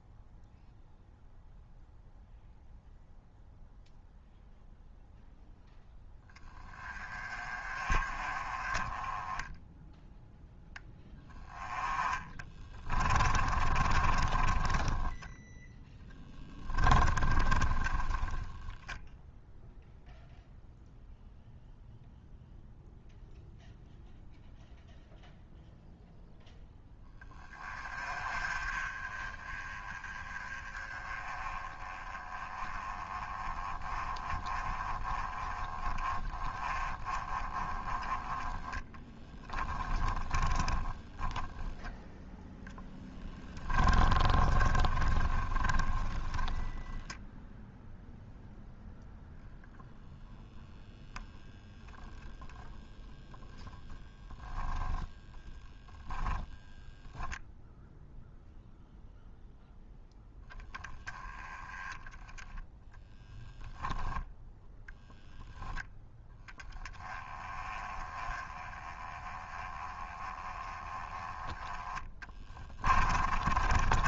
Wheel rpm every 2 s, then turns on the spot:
0, 0, 0, 20, 20, 10, 20, 10, 20, 10, 0, 0, 0, 10, 30, 20, 20, 30, 20, 10, 10, 10, 30, 20, 0, 0, 0, 0, 20, 0, 10, 10, 0, 10, 20, 10, 20.
12-18 38-48 72-74